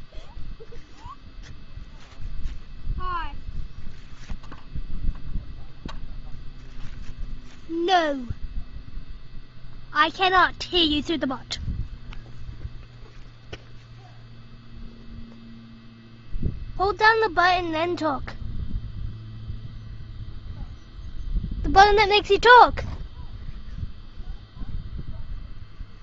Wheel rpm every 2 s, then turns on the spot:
0, 0, 0, 0, 0, 0, 0, 0, 0, 0, 0, 0, 0.
none